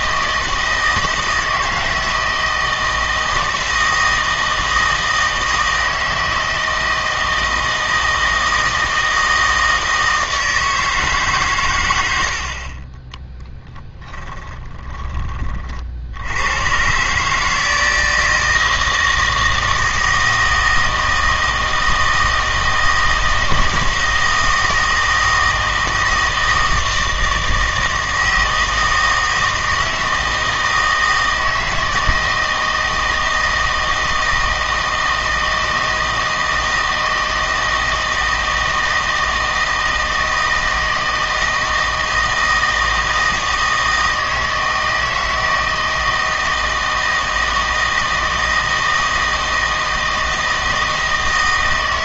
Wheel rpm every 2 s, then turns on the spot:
160, 160, 160, 160, 160, 160, 50, 10, 110, 160, 160, 160, 160, 160, 160, 160, 160, 160, 160, 160, 160, 160, 160, 160, 160, 160.
12-16